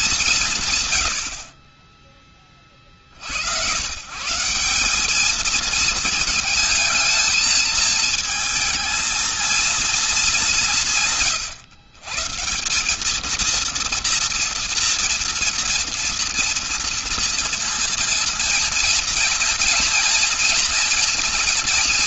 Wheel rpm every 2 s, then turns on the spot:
90, 60, 200, 220, 230, 160, 200, 230, 230, 230, 240.
none